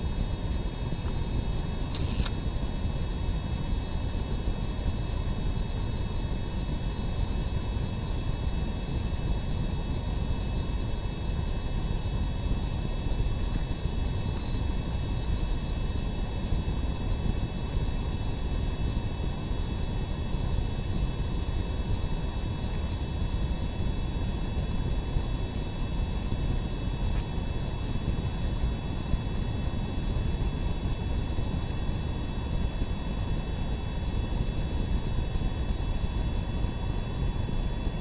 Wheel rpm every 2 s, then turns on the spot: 0, 0, 0, 0, 0, 0, 0, 0, 0, 0, 0, 0, 0, 0, 0, 0, 0, 0, 0.
none